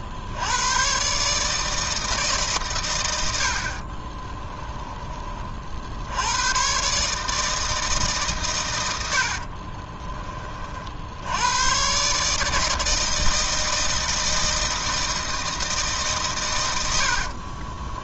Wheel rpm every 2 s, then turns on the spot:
110, 120, 10, 130, 90, 50, 160, 160, 90.
16-18